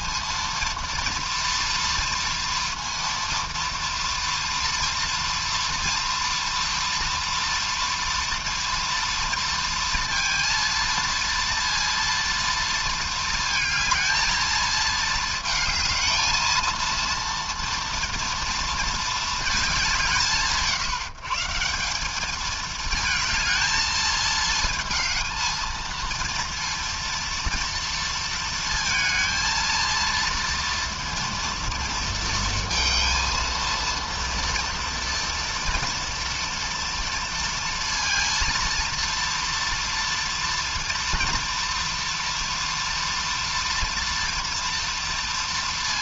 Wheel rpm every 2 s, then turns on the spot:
230, 230, 230, 230, 230, 230, 230, 220, 220, 230, 160, 220, 220, 230, 230, 230, 230, 230, 230, 230, 230, 230, 230.
none